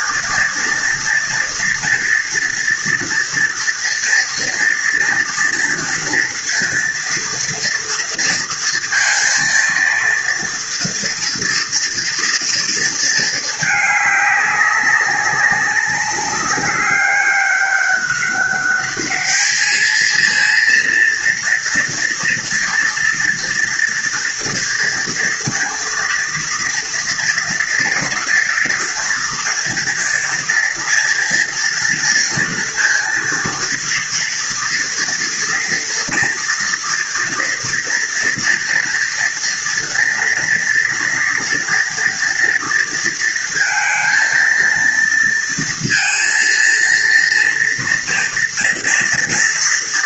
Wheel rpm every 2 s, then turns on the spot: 230, 240, 230, 230, 230, 230, 220, 190, 200, 210, 230, 230, 230, 230, 230, 230, 230, 230, 230, 230, 230, 230, 230, 230, 230.
none